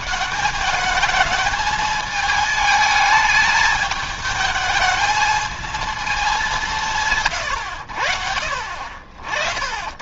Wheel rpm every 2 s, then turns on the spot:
200, 210, 220, 170, 40.
none